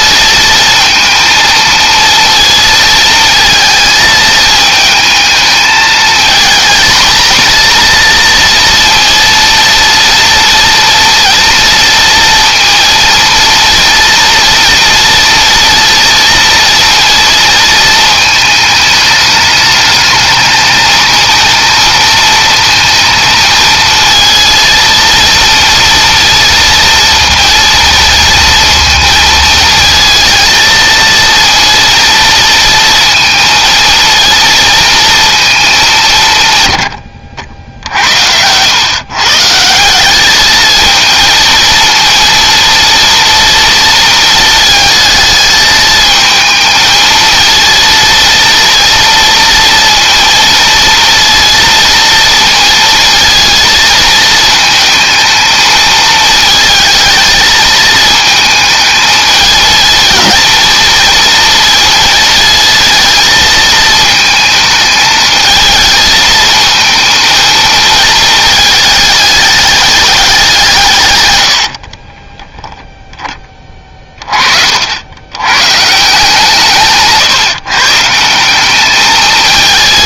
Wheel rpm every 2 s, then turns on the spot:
220, 230, 220, 230, 230, 230, 230, 230, 230, 210, 220, 230, 230, 230, 220, 230, 230, 230, 100, 130, 230, 230, 220, 220, 230, 230, 230, 220, 220, 220, 230, 220, 220, 220, 210, 130, 10, 80, 150, 210.
76-78